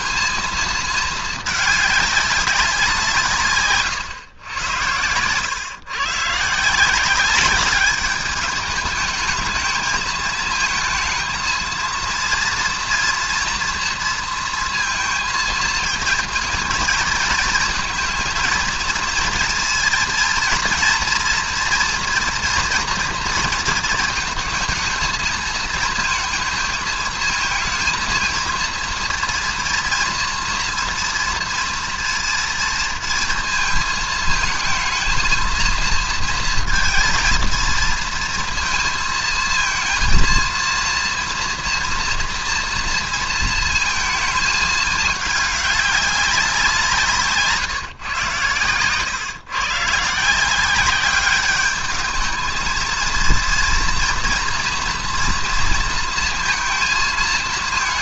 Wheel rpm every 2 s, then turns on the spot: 220, 180, 100, 170, 210, 220, 230, 230, 220, 230, 230, 230, 220, 220, 230, 230, 230, 220, 230, 230, 230, 230, 210, 170, 120, 190, 230, 230, 230.
none